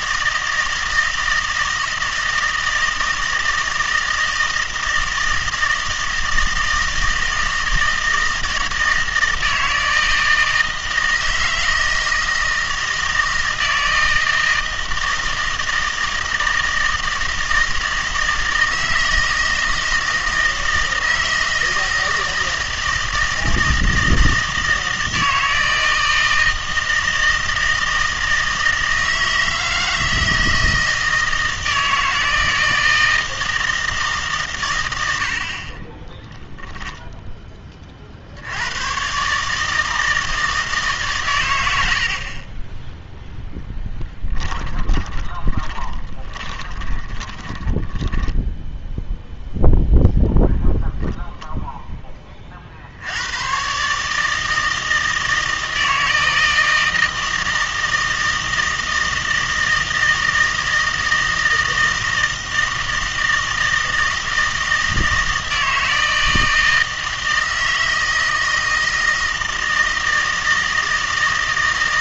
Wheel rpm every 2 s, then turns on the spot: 160, 160, 160, 160, 160, 160, 160, 160, 160, 160, 160, 160, 160, 160, 160, 160, 160, 110, 0, 100, 150, 10, 10, 20, 0, 0, 70, 160, 160, 160, 160, 160, 160, 160, 160, 160.
44-48